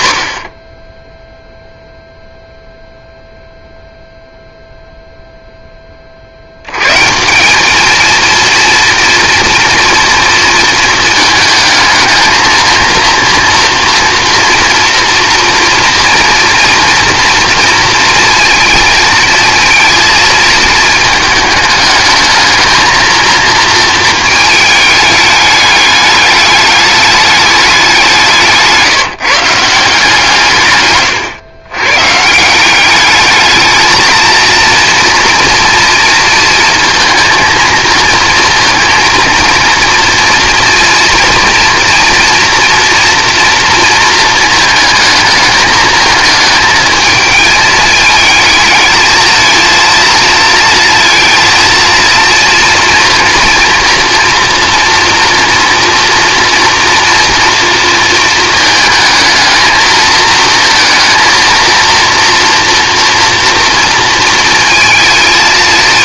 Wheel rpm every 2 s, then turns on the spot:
20, 0, 0, 100, 230, 230, 230, 240, 230, 230, 220, 220, 220, 210, 170, 140, 190, 230, 230, 230, 230, 240, 220, 220, 220, 230, 230, 240, 230, 220, 230, 230, 220.
none